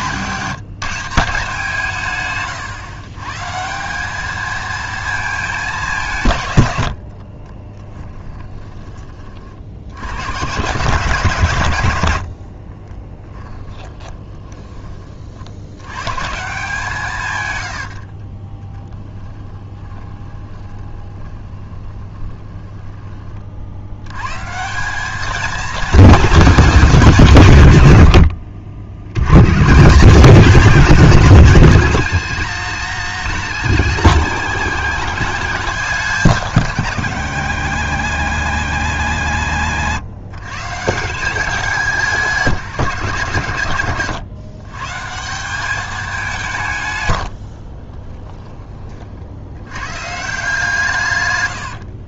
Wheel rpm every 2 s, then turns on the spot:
180, 120, 220, 70, 20, 140, 20, 30, 160, 10, 20, 20, 180, 200, 80, 200, 130, 120, 120, 100, 140, 170, 140, 150, 30, 160.
12-14 18-24